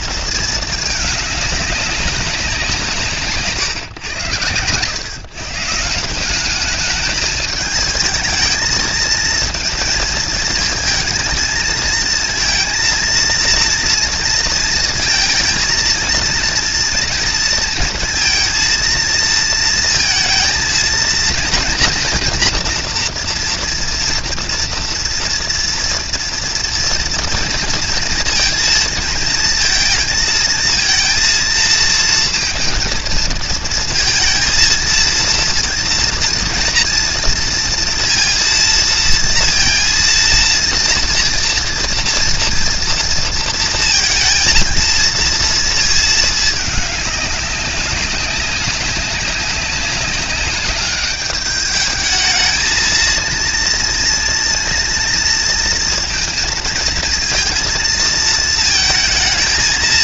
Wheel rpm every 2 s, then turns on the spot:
220, 190, 110, 200, 220, 220, 230, 230, 230, 230, 220, 230, 230, 230, 230, 220, 230, 230, 230, 230, 230, 230, 230, 210, 190, 200, 220, 230, 230, 230.
none